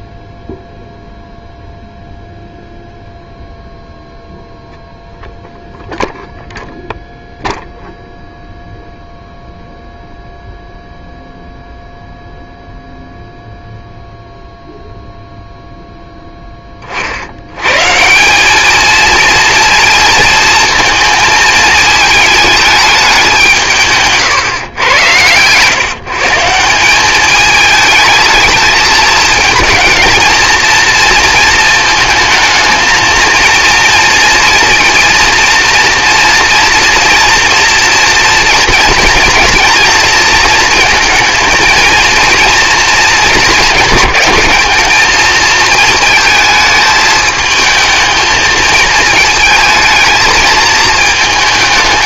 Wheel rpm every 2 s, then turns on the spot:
0, 0, 0, 0, 0, 0, 0, 0, 20, 210, 230, 210, 120, 170, 220, 230, 230, 230, 230, 230, 230, 230, 210, 220, 220, 220.
24-26